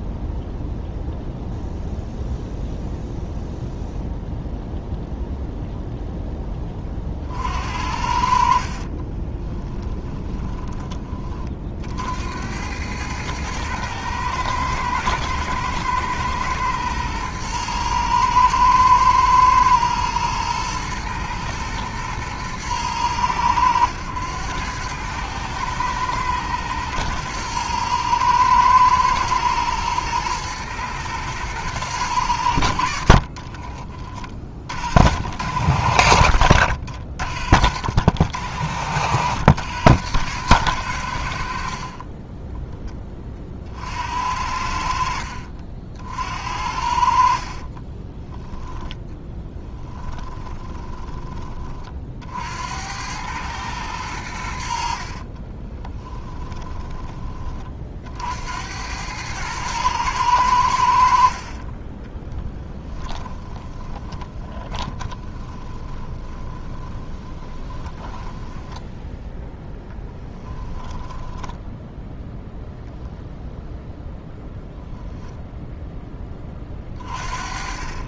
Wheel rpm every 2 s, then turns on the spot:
0, 0, 0, 40, 40, 20, 100, 110, 120, 110, 110, 110, 100, 110, 110, 120, 60, 50, 70, 80, 90, 10, 60, 60, 10, 20, 90, 50, 20, 90, 70, 20, 20, 20, 10, 10, 0, 0, 30.
8-10 32-34 36-38 50-52 54-58 62-68 70-72